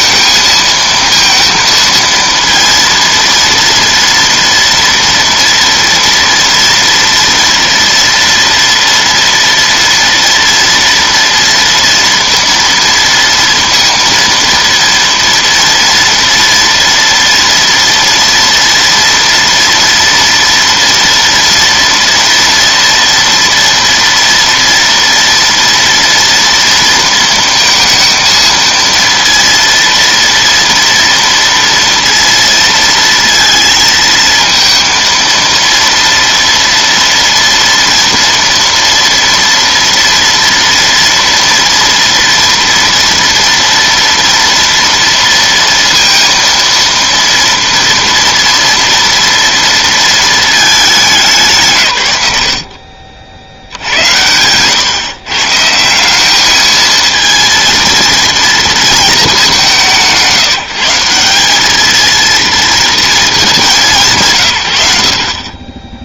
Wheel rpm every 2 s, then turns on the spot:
230, 230, 230, 230, 230, 230, 230, 230, 230, 240, 230, 230, 240, 230, 230, 230, 230, 230, 230, 230, 230, 230, 230, 230, 230, 210, 60, 110, 220, 230, 160, 230, 100.
none